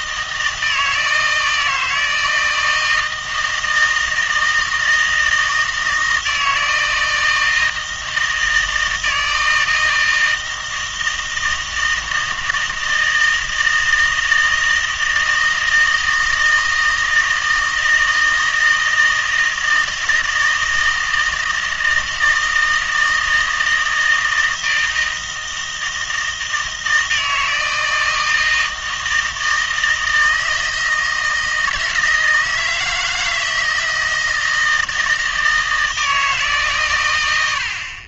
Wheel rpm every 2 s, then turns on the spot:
160, 160, 160, 160, 160, 160, 160, 160, 160, 160, 160, 160, 160, 160, 160, 160, 160, 160, 140.
none